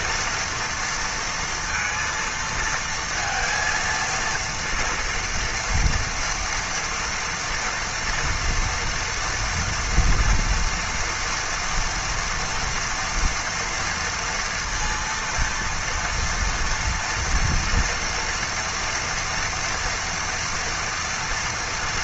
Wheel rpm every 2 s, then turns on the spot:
230, 230, 230, 230, 230, 230, 230, 230, 240, 230, 230.
none